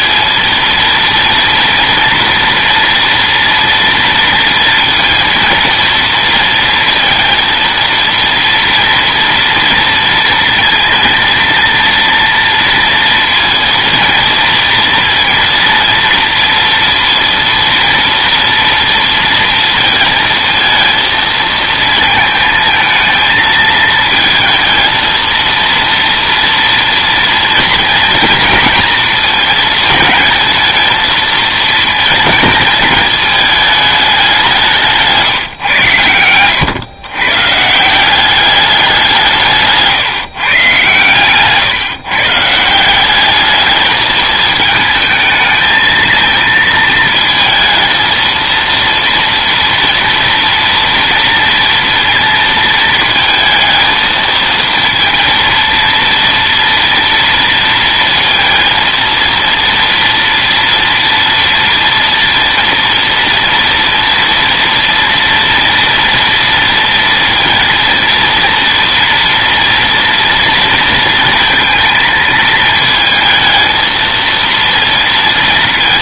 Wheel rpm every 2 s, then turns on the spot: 230, 230, 230, 230, 230, 230, 230, 230, 230, 230, 220, 220, 220, 230, 230, 220, 220, 170, 120, 200, 130, 160, 220, 220, 230, 240, 230, 230, 230, 230, 230, 230, 230, 230, 240, 230, 220, 230.
none